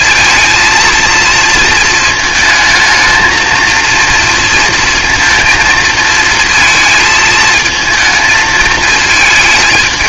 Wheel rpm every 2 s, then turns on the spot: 230, 220, 230, 230, 220.
none